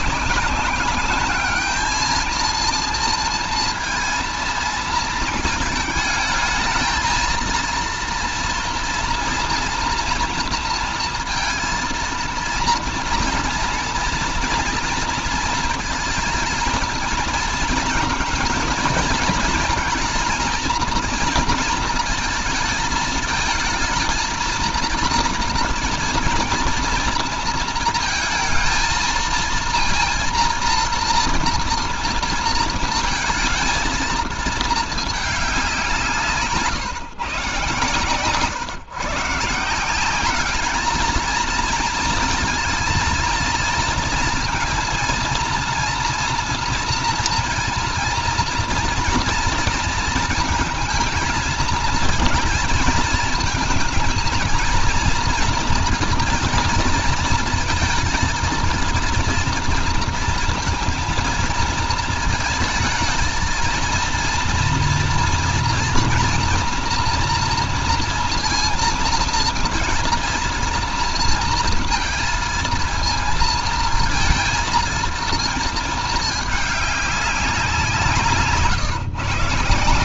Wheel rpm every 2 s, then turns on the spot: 190, 220, 230, 220, 230, 230, 230, 230, 220, 220, 240, 220, 220, 230, 230, 230, 230, 220, 140, 130, 210, 230, 230, 230, 230, 230, 220, 230, 230, 230, 230, 220, 230, 230, 230, 230, 230, 220, 210, 170.
none